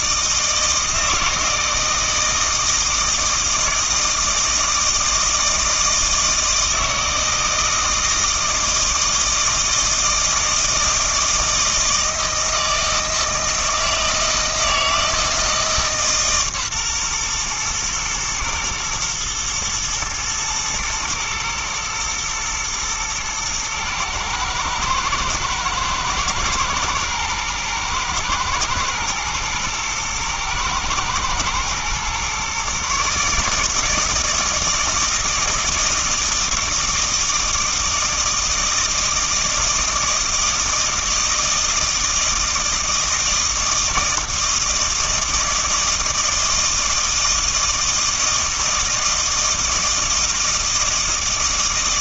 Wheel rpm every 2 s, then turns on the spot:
160, 160, 160, 160, 160, 160, 160, 160, 130, 120, 120, 110, 110, 110, 110, 110, 140, 160, 160, 160, 160, 160, 160, 160, 160, 160.
none